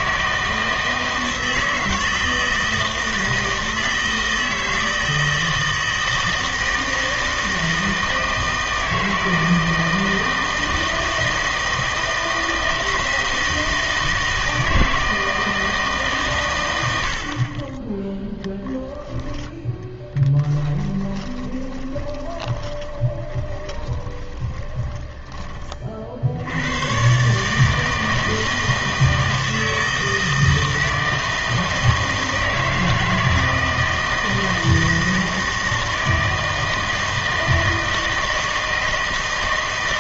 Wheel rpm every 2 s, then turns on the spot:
160, 160, 160, 160, 160, 160, 160, 160, 110, 0, 10, 20, 20, 100, 160, 160, 160, 160, 160, 160.
20-26